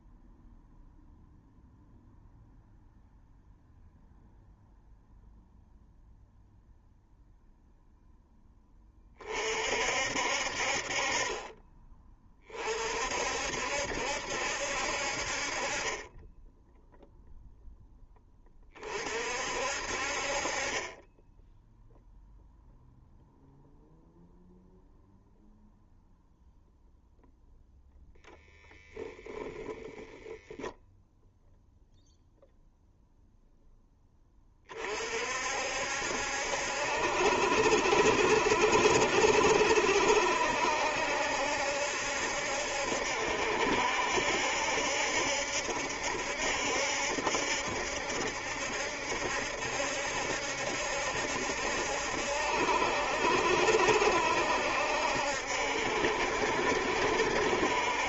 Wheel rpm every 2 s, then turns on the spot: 0, 0, 0, 0, 20, 40, 50, 70, 0, 40, 20, 0, 0, 0, 10, 0, 0, 40, 70, 60, 70, 70, 70, 70, 70, 70, 70, 70, 70.
28-30